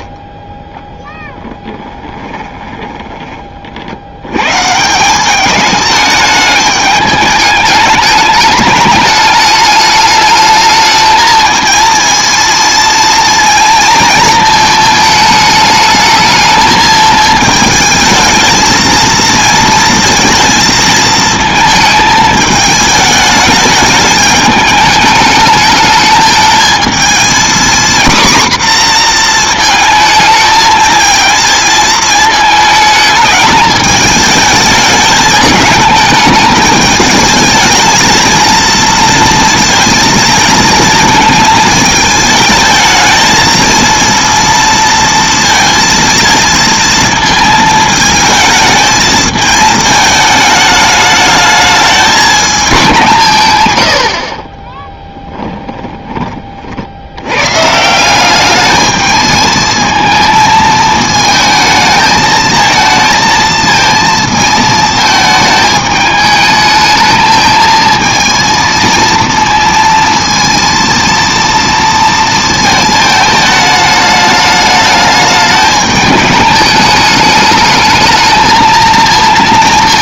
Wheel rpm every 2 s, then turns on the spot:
10, 20, 130, 210, 210, 220, 230, 220, 220, 220, 230, 220, 210, 220, 240, 220, 210, 210, 210, 230, 220, 220, 230, 220, 220, 210, 180, 20, 50, 210, 220, 220, 220, 220, 230, 230, 220, 210, 210, 220.
2-4 54-56